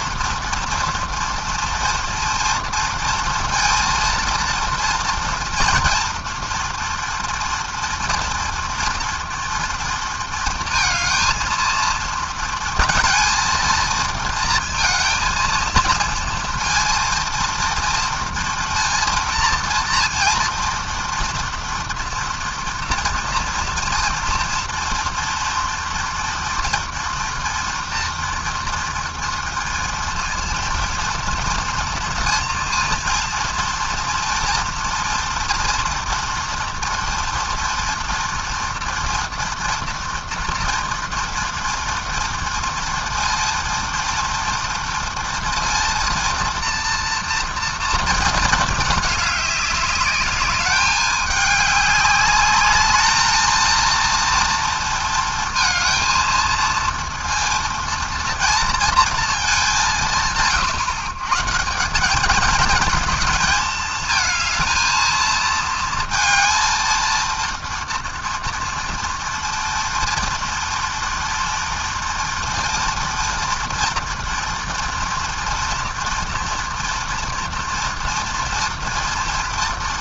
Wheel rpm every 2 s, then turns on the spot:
230, 230, 230, 230, 230, 220, 230, 230, 230, 230, 230, 230, 230, 240, 230, 230, 230, 230, 230, 230, 230, 230, 230, 230, 210, 210, 220, 230, 230, 230, 140, 220, 220, 230, 230, 230, 230, 240, 240, 230.
none